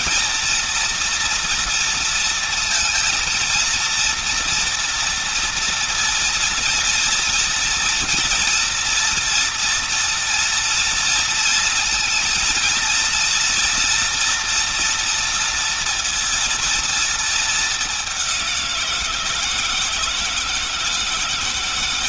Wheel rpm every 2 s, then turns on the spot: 230, 230, 230, 230, 230, 230, 230, 240, 230, 180, 160.
none